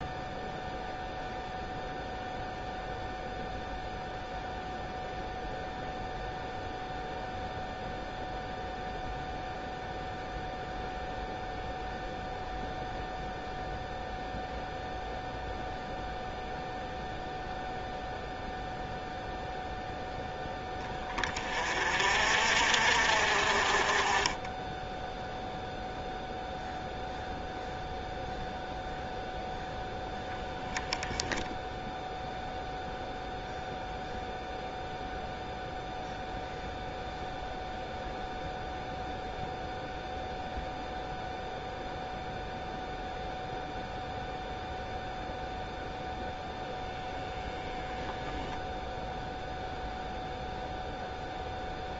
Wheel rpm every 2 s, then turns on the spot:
0, 0, 0, 0, 0, 0, 0, 0, 0, 0, 20, 50, 10, 0, 0, 10, 0, 0, 0, 0, 0, 0, 0, 0, 0, 0.
none